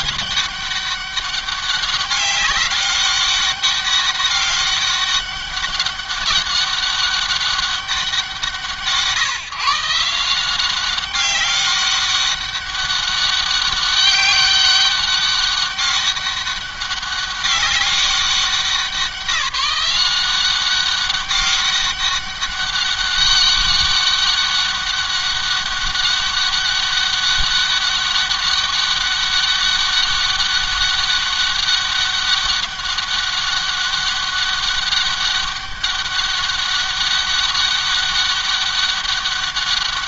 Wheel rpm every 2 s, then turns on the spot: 200, 200, 190, 200, 170, 170, 190, 200, 200, 190, 190, 200, 200, 200, 200, 200, 200, 190, 200, 200.
none